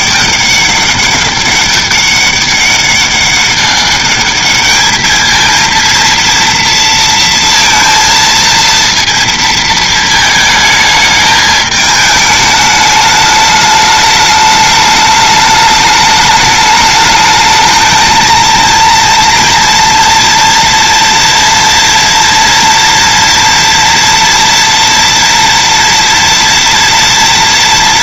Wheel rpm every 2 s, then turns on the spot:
200, 200, 220, 230, 230, 220, 210, 210, 210, 230, 230, 230, 230, 230.
none